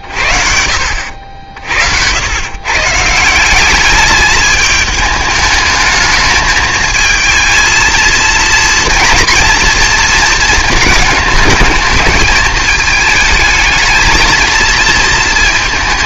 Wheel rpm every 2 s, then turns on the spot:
40, 120, 210, 220, 230, 220, 210, 230.
none